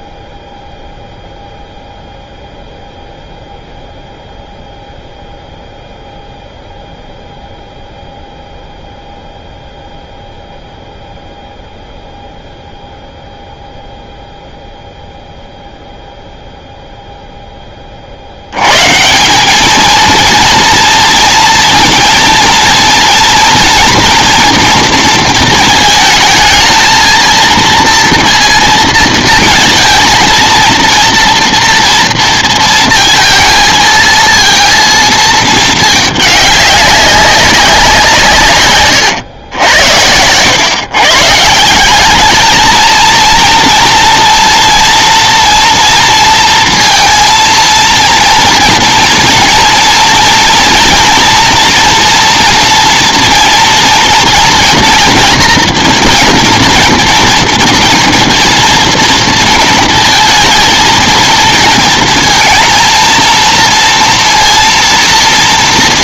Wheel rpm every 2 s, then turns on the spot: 0, 0, 0, 0, 0, 0, 0, 0, 0, 120, 230, 230, 230, 230, 230, 230, 230, 230, 200, 120, 130, 220, 230, 230, 230, 230, 230, 230, 230, 230, 230, 230, 230.
none